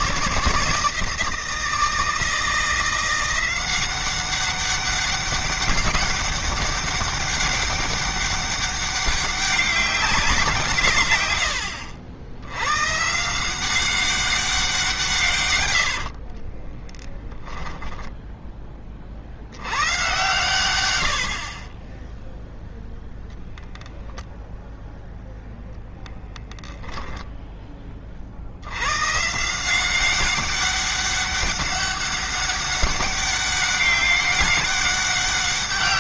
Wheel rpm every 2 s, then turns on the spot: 160, 170, 200, 200, 200, 150, 120, 170, 10, 40, 100, 0, 0, 0, 100, 200, 200, 200.
16-18